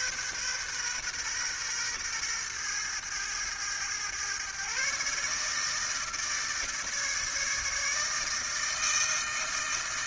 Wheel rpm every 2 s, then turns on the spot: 130, 120, 130, 150, 160.
none